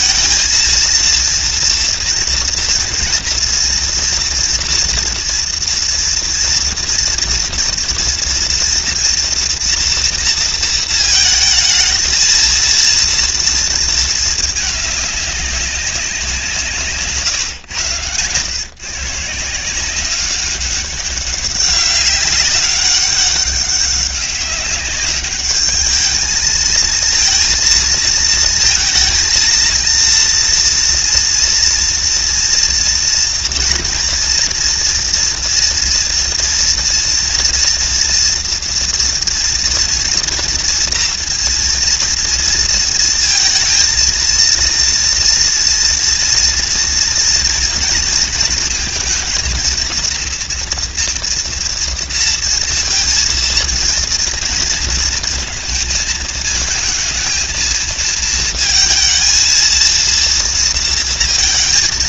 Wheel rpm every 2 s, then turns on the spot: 230, 230, 230, 230, 240, 220, 230, 200, 140, 140, 200, 200, 200, 220, 230, 230, 230, 230, 230, 230, 230, 230, 230, 230, 230, 240, 230, 230, 230, 230, 230.
none